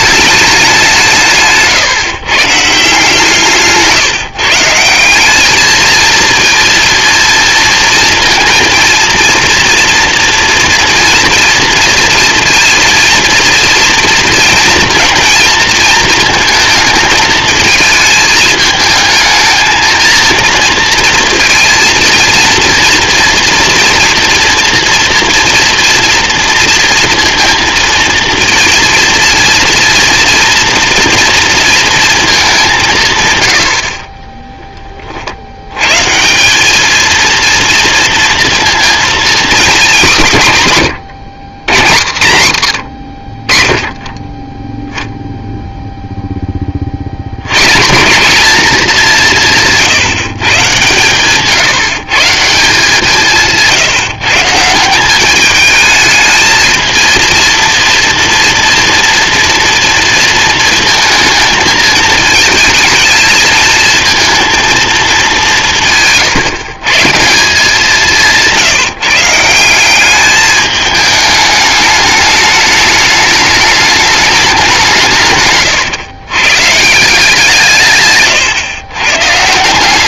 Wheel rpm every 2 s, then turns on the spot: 140, 150, 210, 230, 230, 230, 230, 230, 220, 220, 230, 240, 230, 230, 230, 230, 110, 70, 230, 240, 110, 40, 0, 80, 170, 130, 170, 190, 220, 240, 230, 220, 210, 150, 160, 210, 210, 170, 160, 130.
none